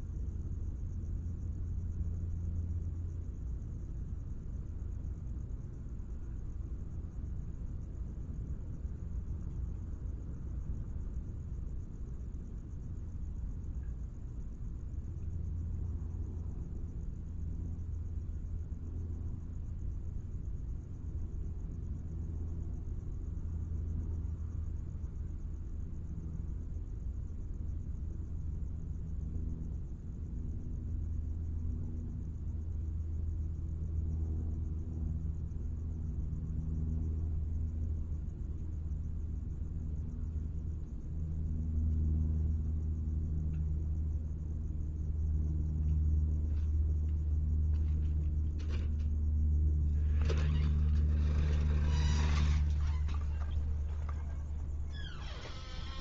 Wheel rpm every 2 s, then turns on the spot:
0, 0, 0, 0, 0, 0, 0, 0, 0, 0, 0, 0, 0, 0, 0, 0, 0, 0, 0, 0, 0, 0, 0, 0, 0, 0, 0, 0.
none